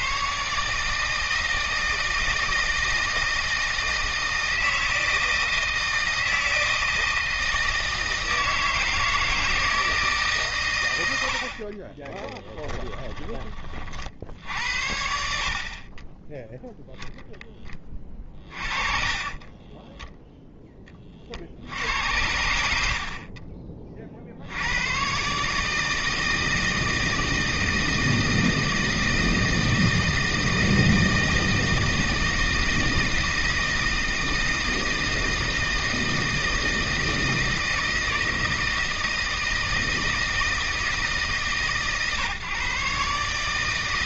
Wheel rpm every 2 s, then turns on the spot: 140, 160, 160, 160, 160, 130, 10, 70, 10, 30, 10, 80, 80, 160, 160, 160, 160, 160, 160, 160, 160, 130.
12-14 18-20